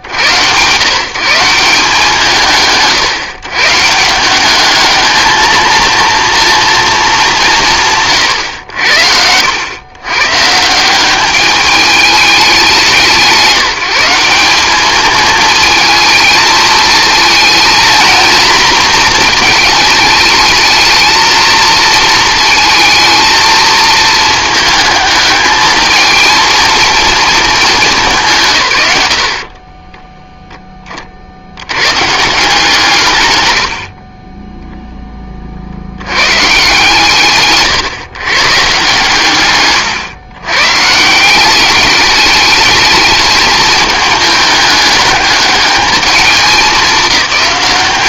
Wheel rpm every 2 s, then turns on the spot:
120, 150, 200, 230, 90, 150, 190, 200, 220, 230, 220, 230, 220, 230, 130, 10, 160, 10, 140, 140, 130, 210, 210, 190.
none